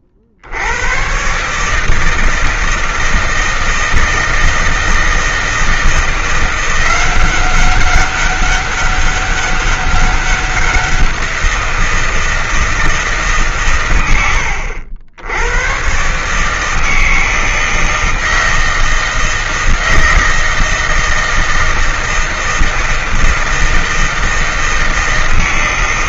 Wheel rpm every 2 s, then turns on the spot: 80, 160, 160, 170, 200, 190, 160, 70, 150, 160, 160, 160, 160.
none